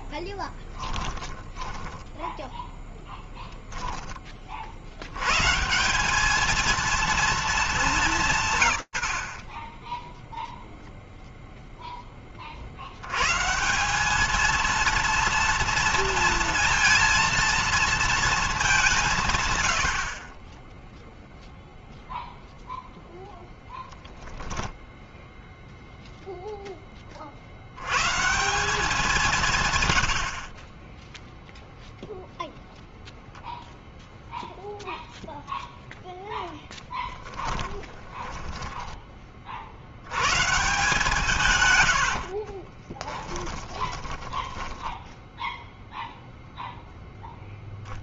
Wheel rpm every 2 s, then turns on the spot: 10, 10, 40, 220, 140, 0, 40, 220, 230, 200, 10, 0, 0, 20, 180, 10, 0, 0, 10, 20, 140, 20, 10, 0.
0-2 36-38 42-46